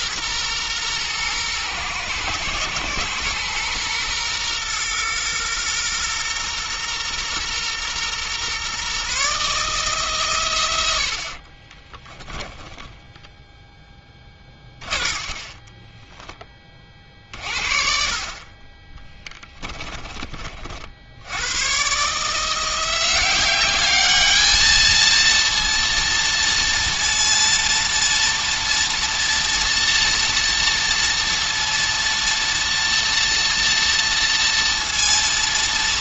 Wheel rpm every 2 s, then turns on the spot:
120, 120, 120, 120, 130, 90, 10, 30, 40, 20, 70, 180, 220, 230, 230, 240, 230, 230.
12-16